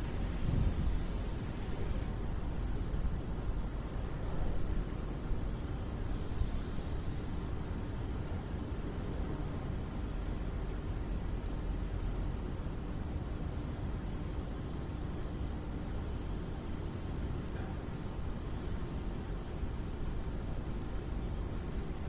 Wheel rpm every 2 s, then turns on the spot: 0, 0, 0, 0, 0, 0, 0, 0, 0, 0, 0.
none